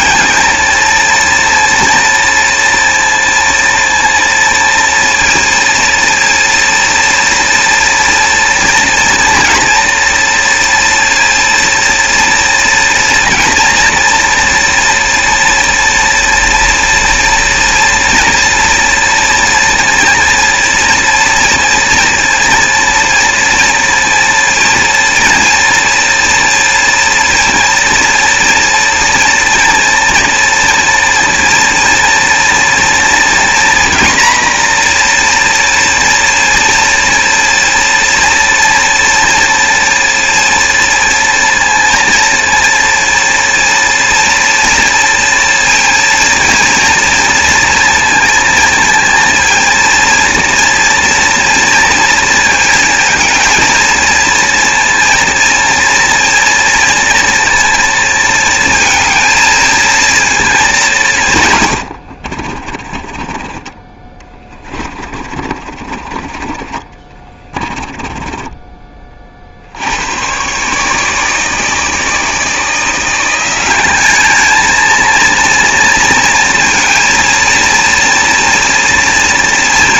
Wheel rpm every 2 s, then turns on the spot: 220, 230, 230, 230, 240, 230, 230, 230, 230, 230, 230, 230, 230, 230, 230, 230, 230, 240, 230, 230, 230, 230, 230, 230, 230, 230, 230, 230, 230, 230, 200, 30, 30, 30, 20, 140, 160, 220, 230, 230.
62-66